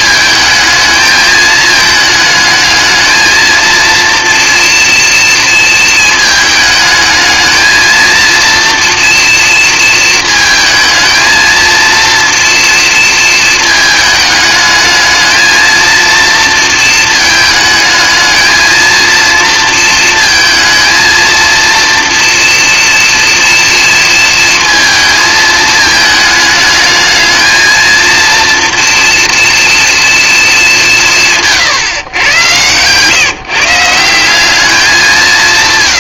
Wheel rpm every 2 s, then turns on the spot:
220, 220, 230, 210, 230, 220, 230, 220, 230, 230, 230, 230, 230, 220, 230, 180, 130, 190.
none